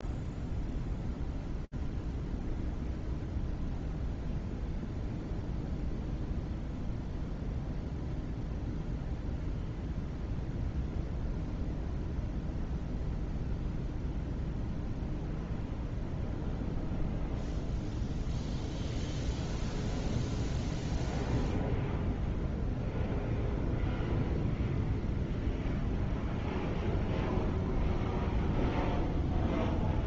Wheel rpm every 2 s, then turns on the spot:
0, 0, 0, 0, 0, 0, 0, 0, 0, 0, 0, 0, 0, 0, 0.
none